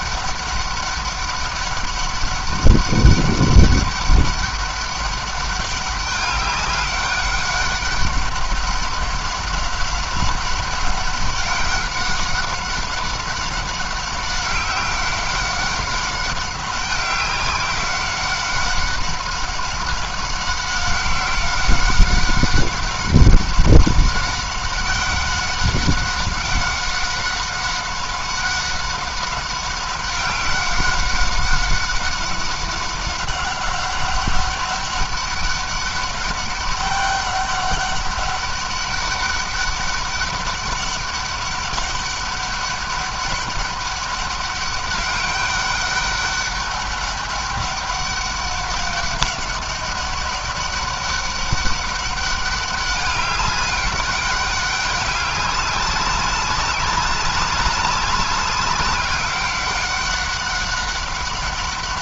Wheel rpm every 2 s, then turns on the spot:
200, 200, 200, 200, 200, 200, 200, 190, 190, 190, 190, 190, 190, 190, 190, 190, 190, 200, 200, 200, 200, 200, 200, 200, 190, 200, 200, 200, 190, 190, 190.
none